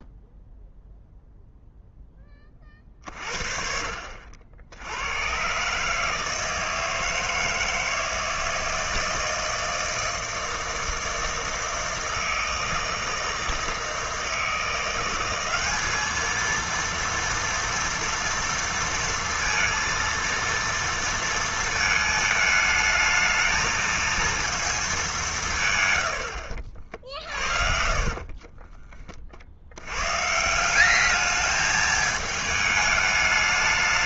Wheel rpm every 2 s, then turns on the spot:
0, 40, 90, 160, 160, 160, 160, 180, 230, 230, 230, 220, 210, 50, 30, 200, 210.
26-28